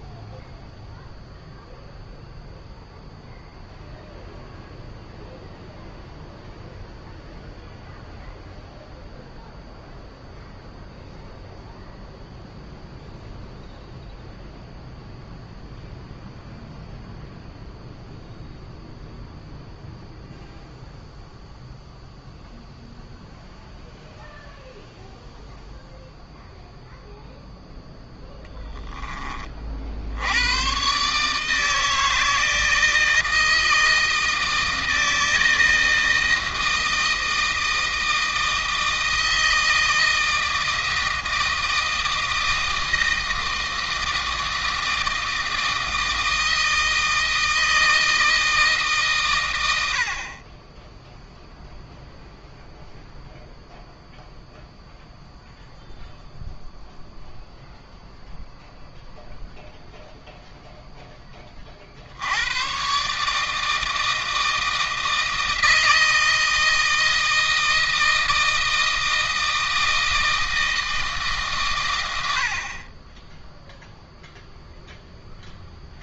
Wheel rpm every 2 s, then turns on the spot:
0, 0, 0, 0, 0, 0, 0, 0, 0, 0, 0, 0, 0, 0, 10, 120, 160, 160, 160, 160, 160, 160, 160, 160, 140, 10, 0, 0, 0, 0, 0, 120, 160, 160, 160, 160, 40, 0.
none